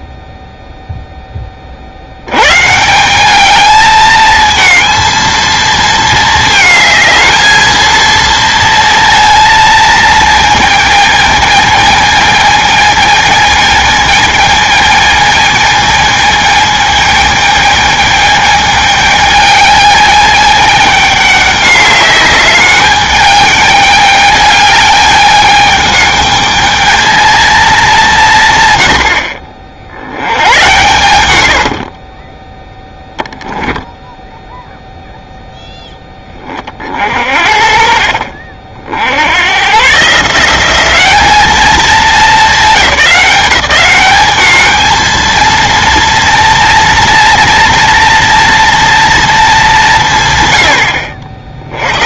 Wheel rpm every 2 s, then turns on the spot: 0, 140, 220, 220, 230, 220, 220, 220, 220, 210, 210, 210, 210, 220, 110, 100, 10, 0, 30, 50, 190, 180, 210, 240, 240, 100.
32-34